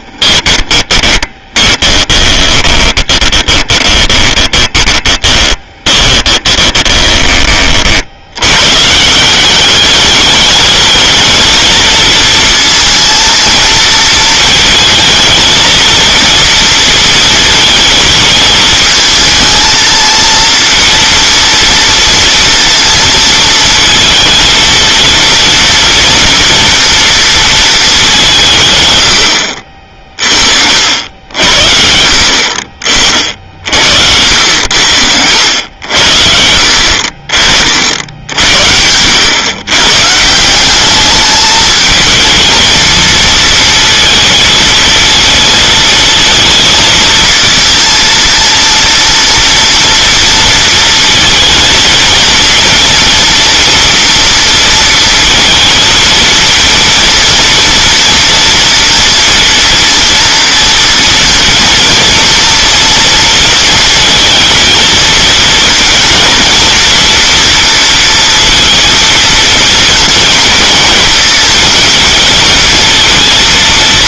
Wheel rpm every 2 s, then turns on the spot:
20, 20, 20, 20, 120, 210, 230, 220, 230, 220, 230, 230, 230, 240, 150, 60, 50, 80, 70, 70, 180, 230, 230, 220, 230, 230, 230, 230, 230, 230, 230, 230, 220, 230, 230, 230, 230.
0-8 34-36